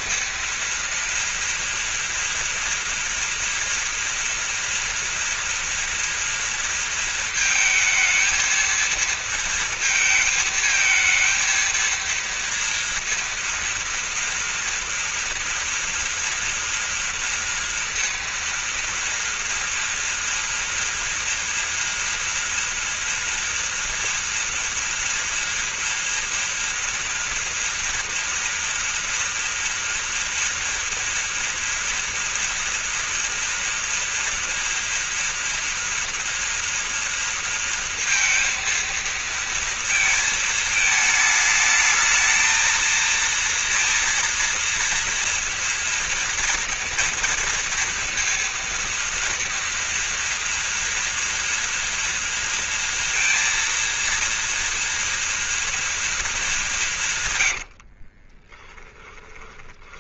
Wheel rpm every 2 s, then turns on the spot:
230, 230, 230, 230, 230, 220, 230, 230, 230, 230, 230, 240, 240, 230, 230, 230, 230, 230, 230, 230, 220, 230, 230, 230, 230, 230, 230, 230, 180, 20.
58-60